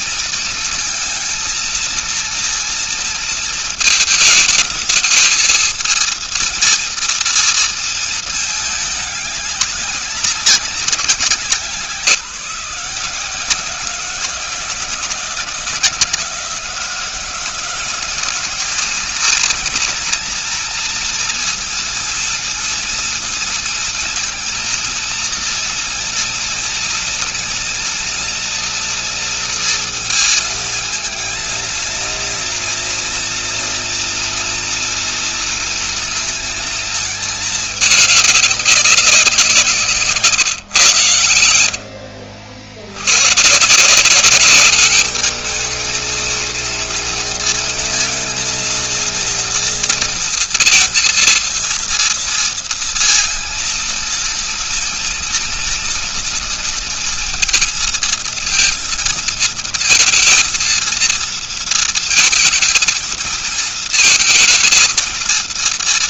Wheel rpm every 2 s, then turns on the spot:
230, 230, 220, 230, 220, 190, 160, 180, 180, 210, 230, 230, 230, 230, 230, 230, 230, 240, 230, 200, 140, 80, 200, 230, 230, 230, 230, 230, 230, 230, 230, 230, 230.
none